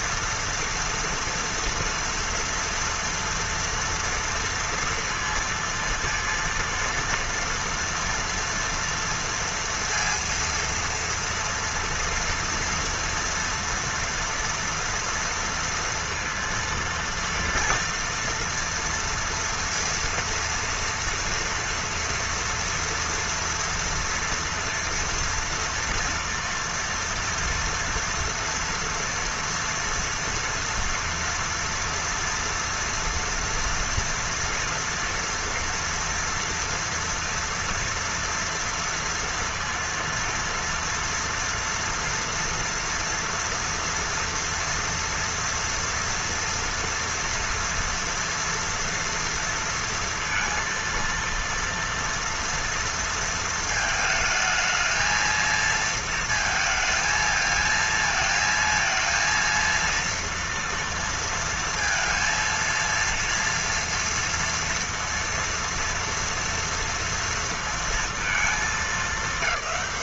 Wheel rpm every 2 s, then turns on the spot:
230, 230, 230, 230, 230, 230, 240, 240, 230, 230, 230, 230, 240, 230, 230, 230, 240, 230, 230, 230, 230, 230, 230, 230, 230, 230, 230, 220, 220, 230, 230, 230, 230, 230, 220.
none